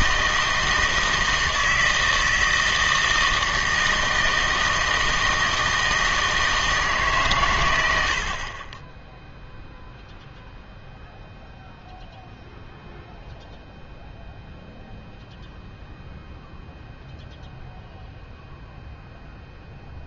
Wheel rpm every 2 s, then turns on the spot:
160, 160, 160, 160, 30, 0, 0, 0, 0, 0.
none